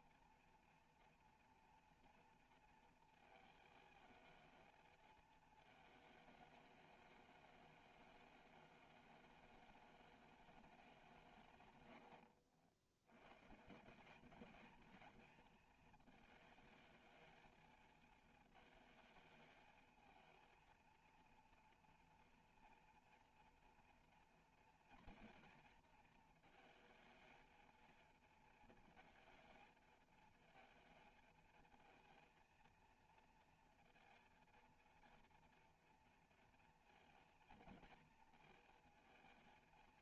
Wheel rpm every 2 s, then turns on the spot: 230, 230, 220, 210, 210, 200, 70, 220, 220, 220, 230, 240, 230, 220, 230, 230, 230, 230, 230, 230.
none